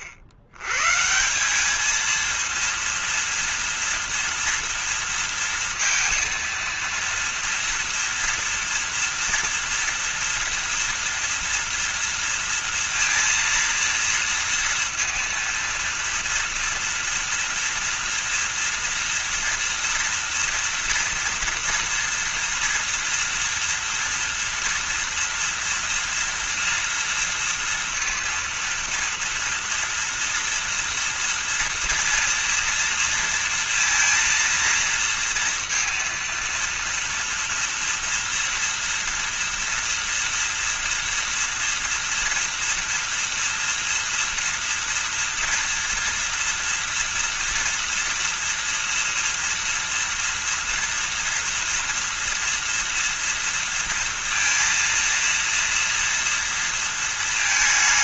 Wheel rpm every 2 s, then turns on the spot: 80, 230, 230, 230, 230, 230, 230, 230, 230, 230, 230, 230, 230, 240, 230, 230, 230, 230, 230, 230, 230, 230, 240, 230, 240, 230, 230, 230, 230.
none